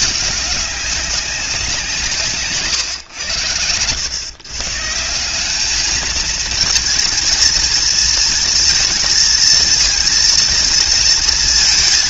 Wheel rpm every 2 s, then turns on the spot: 200, 130, 130, 220, 230, 230.
none